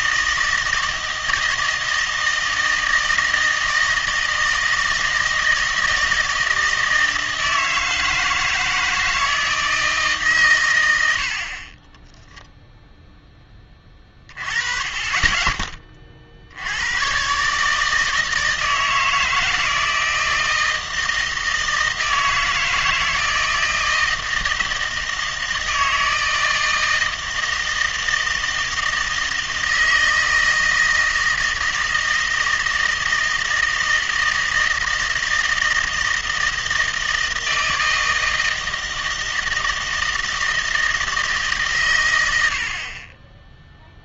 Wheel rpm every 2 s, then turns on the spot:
160, 160, 160, 160, 160, 100, 0, 20, 90, 160, 160, 160, 160, 160, 160, 160, 160, 160, 160, 160, 160, 50.
none